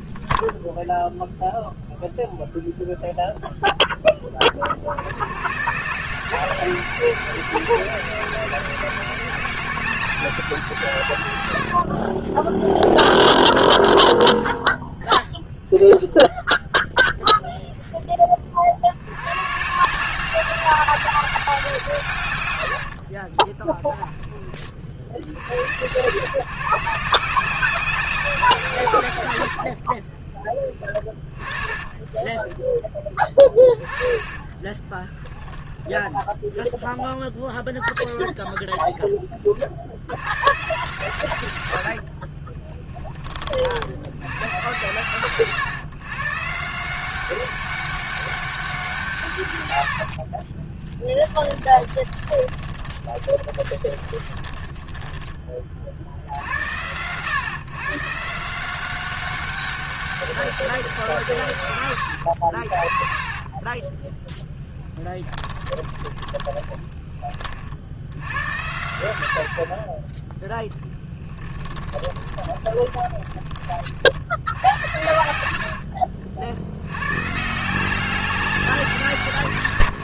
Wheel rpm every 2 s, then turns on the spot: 0, 0, 60, 190, 200, 150, 10, 0, 0, 120, 190, 30, 80, 190, 50, 20, 20, 10, 0, 50, 90, 50, 130, 200, 110, 20, 20, 20, 130, 190, 140, 30, 20, 30, 70, 10, 20, 90, 110, 170.
22-24 28-30 32-36 40-42 50-54 62-66 70-72 74-76